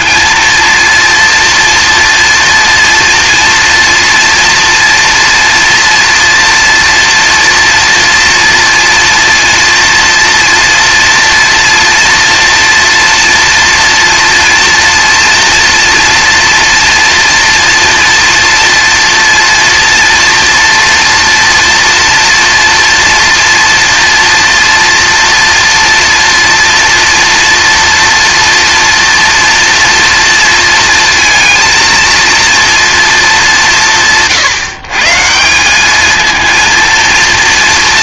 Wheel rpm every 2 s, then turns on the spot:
230, 230, 230, 230, 230, 230, 240, 230, 230, 230, 230, 230, 240, 230, 230, 230, 230, 140, 230.
none